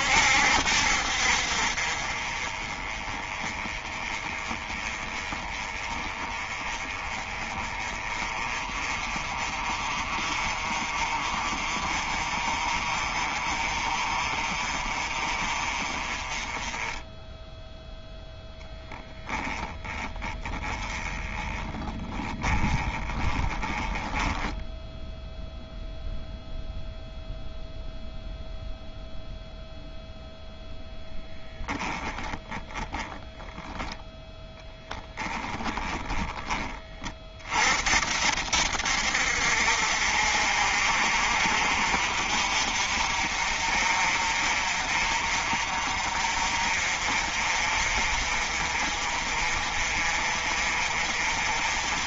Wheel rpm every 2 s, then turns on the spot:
60, 30, 20, 20, 30, 30, 30, 30, 10, 10, 20, 20, 0, 0, 0, 0, 20, 10, 30, 70, 50, 50, 40, 50, 40, 40.
18-24 32-34